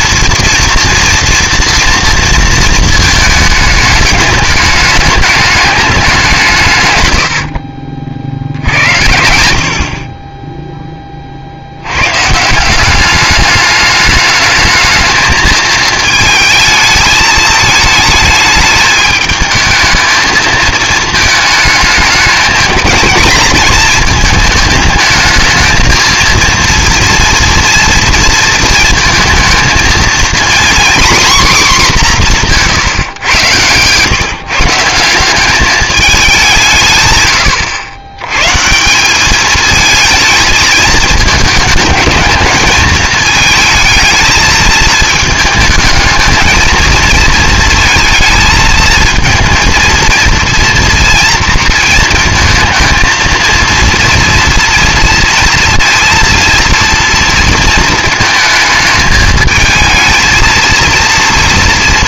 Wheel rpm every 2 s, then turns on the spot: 230, 220, 210, 110, 80, 10, 180, 220, 220, 210, 220, 210, 220, 230, 220, 250, 150, 160, 140, 170, 220, 220, 220, 220, 220, 230, 220, 240, 230, 220, 230.
none